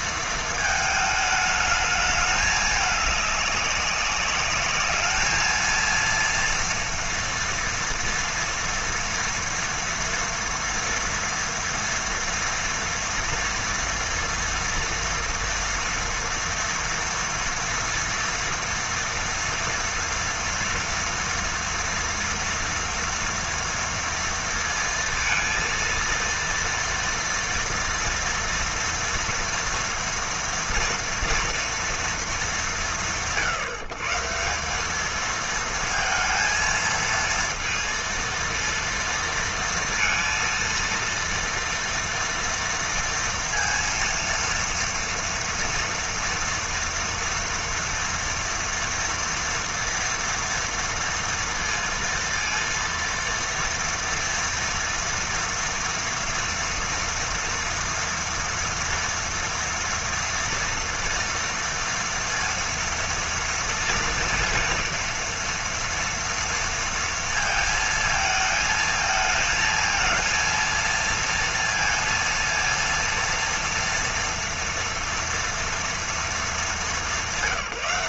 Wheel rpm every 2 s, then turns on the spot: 220, 210, 210, 230, 230, 230, 230, 230, 230, 240, 230, 240, 230, 230, 230, 230, 150, 200, 230, 230, 230, 230, 230, 230, 230, 230, 230, 230, 230, 230, 230, 230, 230, 230, 220, 230, 230, 230, 220.
none